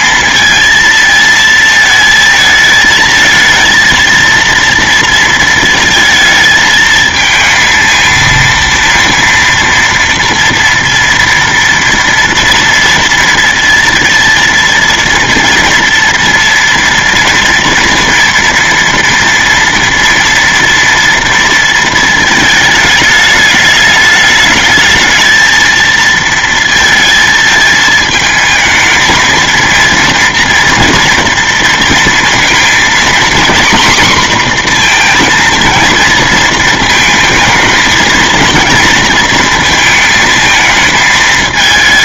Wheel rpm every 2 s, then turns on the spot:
230, 220, 230, 220, 230, 230, 230, 230, 230, 230, 230, 220, 210, 220, 220, 230, 230, 240, 220, 230, 220.
none